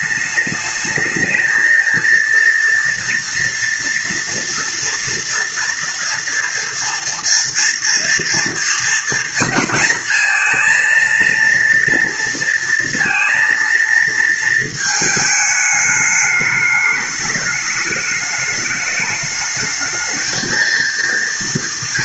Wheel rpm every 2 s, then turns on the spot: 210, 230, 230, 230, 240, 230, 230, 220, 210, 210, 230.
none